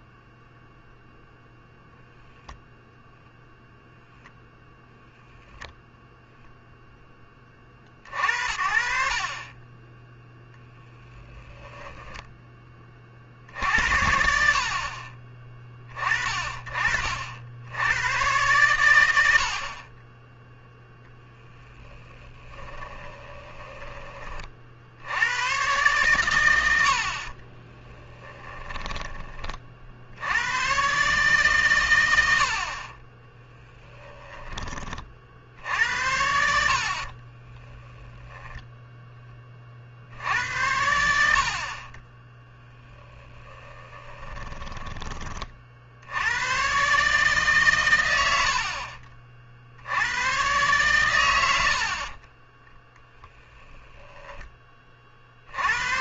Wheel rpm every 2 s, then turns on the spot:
0, 10, 0, 0, 60, 10, 20, 50, 40, 110, 10, 20, 50, 90, 10, 120, 40, 20, 70, 10, 80, 10, 10, 130, 50, 110, 10, 30.
22-24 28-30 42-46